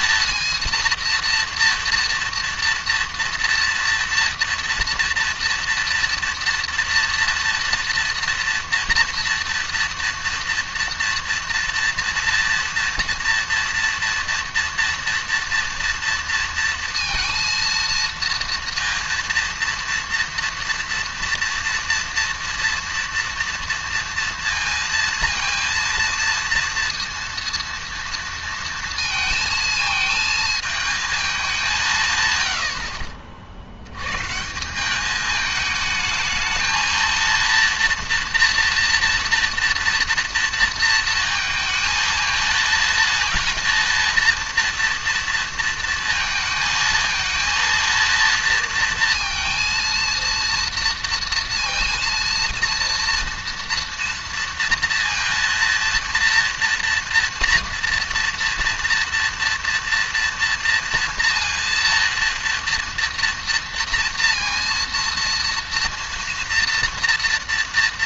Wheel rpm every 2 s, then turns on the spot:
230, 230, 230, 230, 230, 230, 230, 230, 230, 230, 230, 230, 230, 230, 230, 220, 90, 160, 220, 230, 230, 220, 230, 220, 230, 230, 230, 230, 230, 230, 230, 230, 230, 240.
none